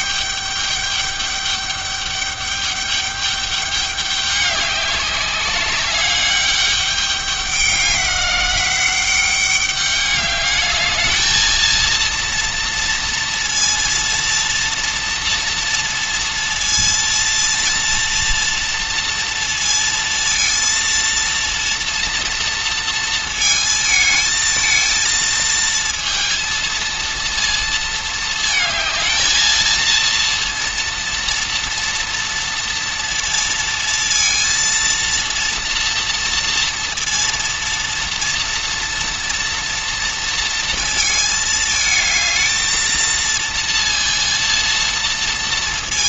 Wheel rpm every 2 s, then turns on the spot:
200, 200, 200, 200, 190, 210, 230, 230, 230, 230, 230, 230, 220, 230, 220, 230, 230, 230, 230, 230, 230, 220, 230.
none